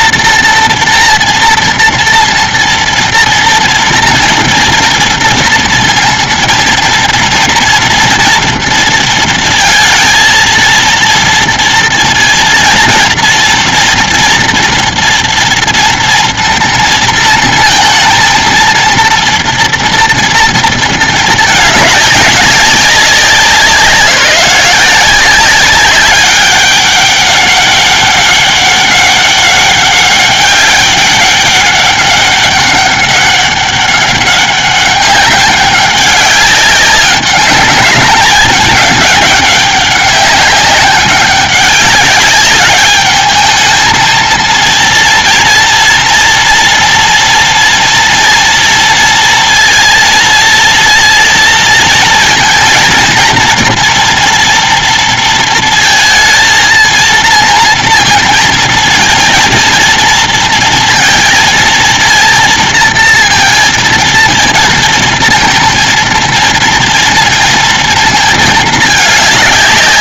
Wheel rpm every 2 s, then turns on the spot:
240, 230, 230, 230, 230, 230, 230, 230, 230, 230, 230, 200, 180, 200, 200, 200, 200, 200, 200, 210, 200, 200, 220, 230, 230, 230, 230, 230, 230, 230, 230, 230, 230, 230, 220.
none